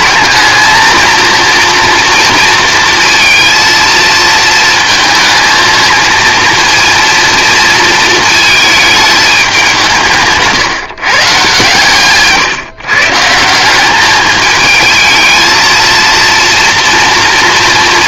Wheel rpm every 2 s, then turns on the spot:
230, 230, 220, 230, 220, 150, 150, 220, 230.
none